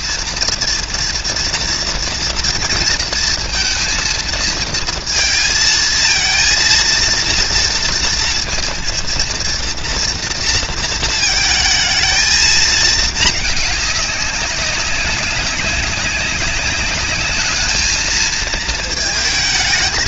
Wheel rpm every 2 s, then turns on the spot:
230, 230, 230, 230, 230, 230, 220, 190, 210, 230.
none